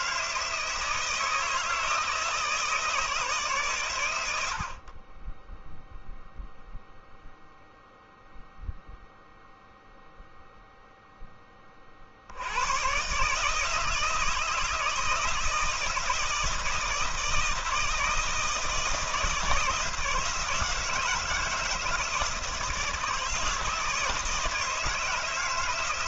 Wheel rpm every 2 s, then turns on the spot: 160, 150, 30, 0, 0, 0, 130, 160, 160, 170, 170, 160, 160.
none